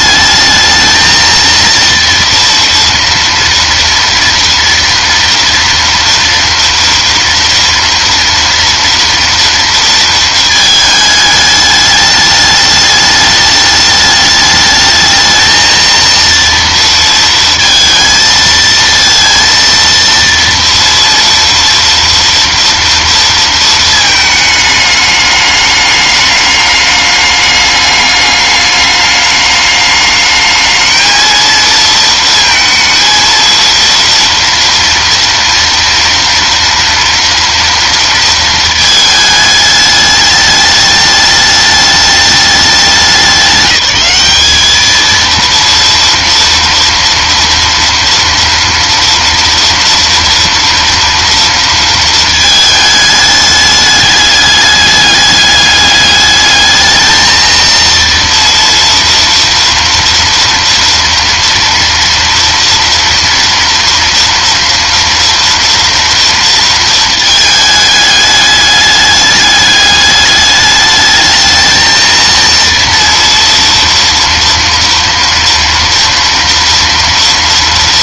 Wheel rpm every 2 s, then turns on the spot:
220, 230, 230, 230, 230, 220, 210, 210, 230, 230, 230, 230, 210, 210, 210, 220, 230, 230, 230, 220, 210, 200, 200, 230, 230, 240, 220, 210, 210, 240, 230, 230, 230, 230, 210, 210, 230, 230, 230.
none